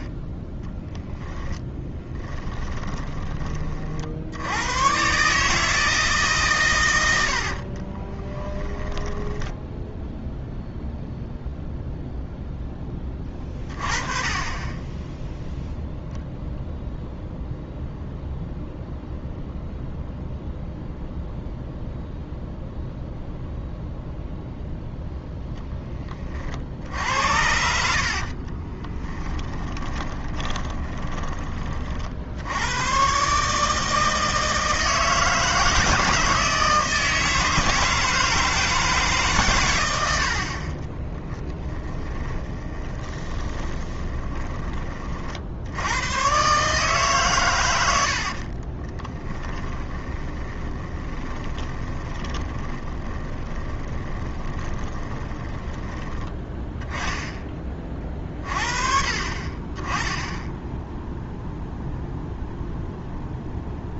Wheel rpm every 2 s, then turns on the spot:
10, 20, 100, 120, 10, 0, 10, 20, 0, 0, 0, 0, 0, 60, 30, 20, 100, 160, 160, 160, 40, 20, 30, 140, 30, 20, 20, 20, 20, 40, 10, 0.
2-4 8-10 28-32 40-44 48-56